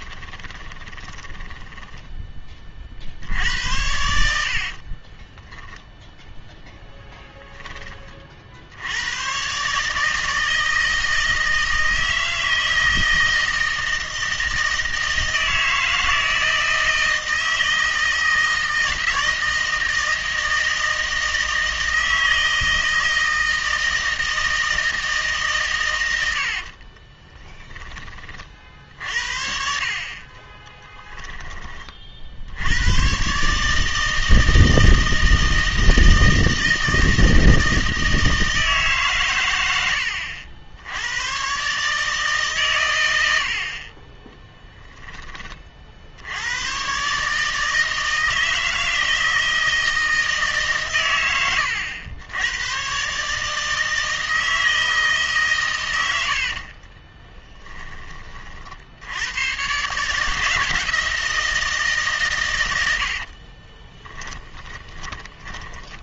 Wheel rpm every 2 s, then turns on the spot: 30, 30, 50, 0, 70, 160, 160, 160, 160, 160, 160, 160, 160, 60, 50, 20, 100, 160, 160, 150, 90, 130, 10, 110, 160, 140, 110, 160, 50, 60, 170, 100, 10.
0-2 4-6 26-28 30-32 56-58